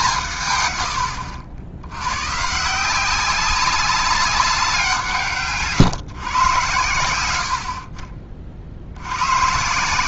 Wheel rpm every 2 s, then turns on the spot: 110, 160, 180, 110, 70.
none